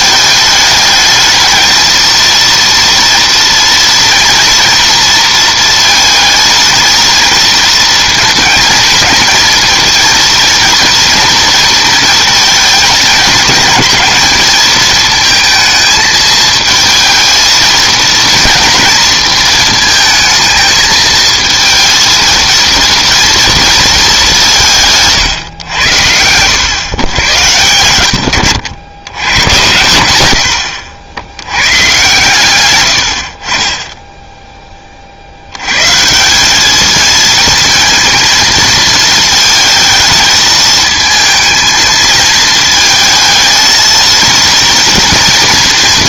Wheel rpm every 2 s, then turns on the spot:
220, 230, 230, 220, 230, 230, 220, 220, 220, 230, 220, 230, 190, 110, 90, 80, 100, 20, 200, 230, 220, 220, 230.
none